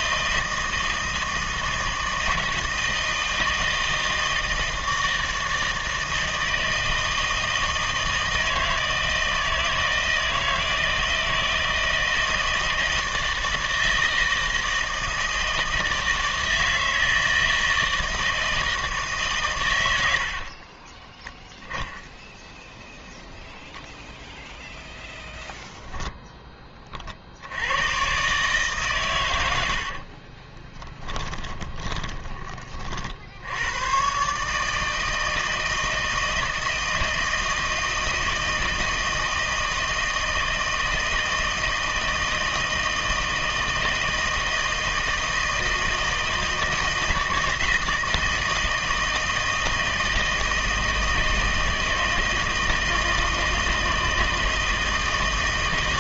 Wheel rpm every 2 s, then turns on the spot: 160, 160, 160, 160, 160, 160, 160, 160, 160, 160, 30, 10, 0, 30, 140, 20, 40, 160, 160, 160, 160, 160, 160, 160, 160, 160, 160, 160.
20-22 30-32